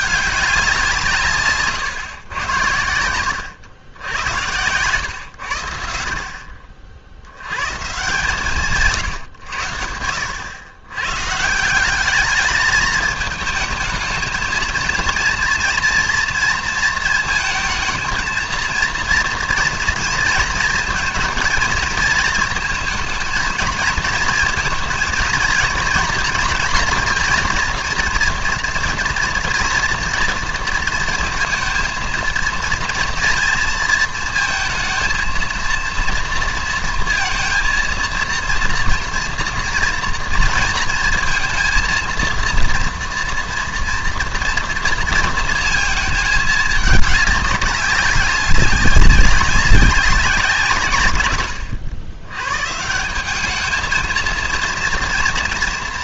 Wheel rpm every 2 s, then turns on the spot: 180, 90, 110, 50, 150, 100, 210, 220, 220, 230, 220, 220, 230, 230, 230, 230, 230, 230, 230, 230, 230, 230, 230, 210, 200, 150, 140, 230.
none